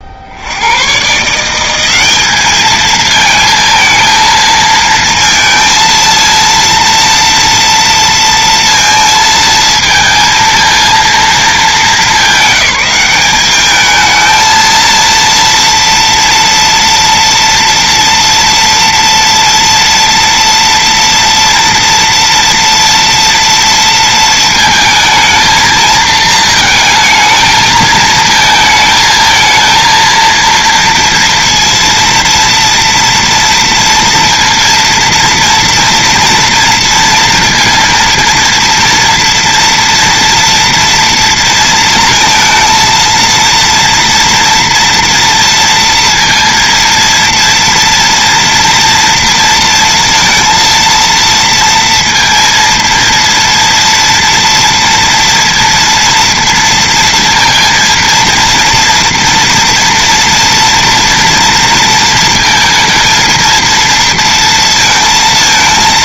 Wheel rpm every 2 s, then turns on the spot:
100, 220, 230, 230, 230, 230, 210, 230, 230, 230, 230, 230, 230, 220, 220, 230, 230, 230, 240, 230, 230, 230, 240, 230, 230, 230, 230, 230, 230, 230, 230, 230, 230.
none